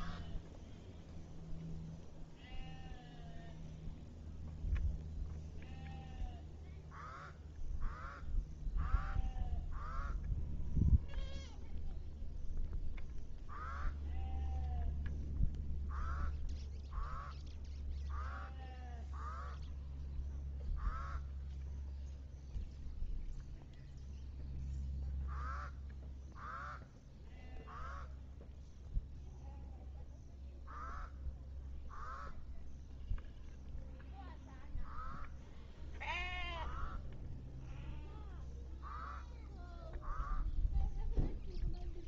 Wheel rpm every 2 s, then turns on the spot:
0, 0, 0, 0, 0, 0, 0, 0, 0, 0, 0, 0, 0, 0, 0, 0, 0, 0, 0, 0, 0.
none